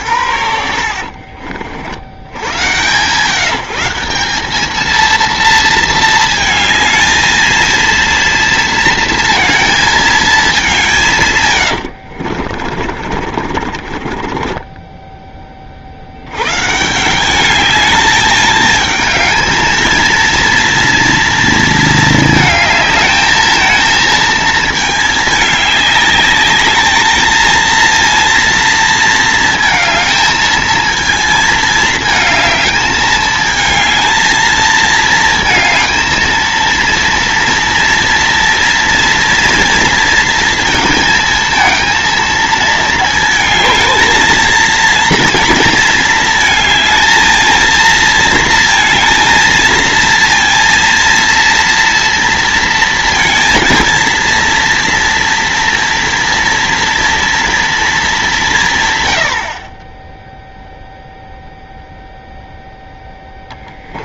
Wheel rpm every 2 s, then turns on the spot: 60, 110, 210, 220, 230, 180, 40, 20, 150, 220, 230, 220, 220, 210, 230, 220, 220, 220, 230, 240, 230, 230, 230, 220, 220, 230, 220, 230, 230, 150, 0, 0.
0-2 12-16